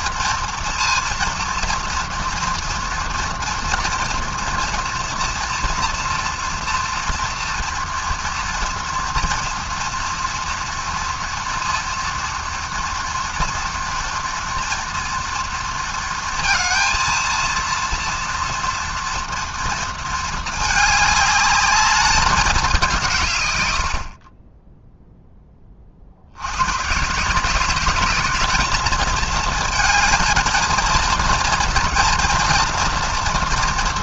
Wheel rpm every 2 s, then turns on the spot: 240, 230, 230, 230, 230, 230, 230, 240, 230, 240, 220, 200, 20, 100, 210, 220, 240.
none